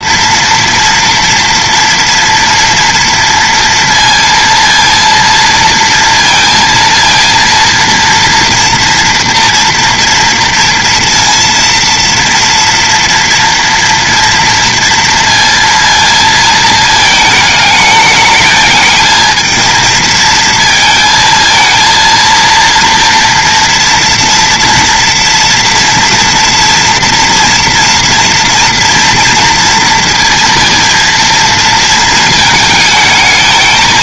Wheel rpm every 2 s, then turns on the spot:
230, 230, 230, 230, 230, 230, 230, 230, 230, 210, 230, 230, 230, 230, 240, 230, 220.
none